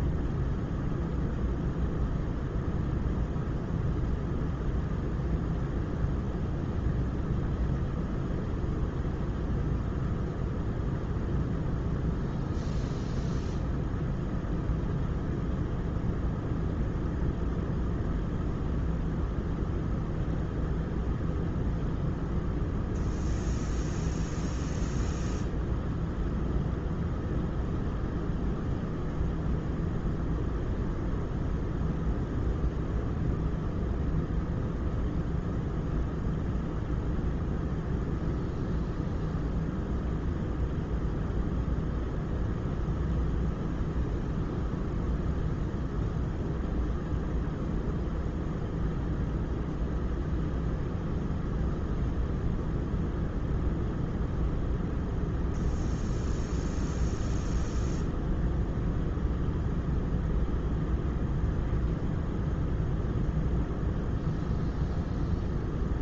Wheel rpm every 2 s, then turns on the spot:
0, 0, 0, 0, 0, 0, 0, 0, 0, 0, 0, 0, 0, 0, 0, 0, 0, 0, 0, 0, 0, 0, 0, 0, 0, 0, 0, 0, 0, 0, 0, 0, 0.
none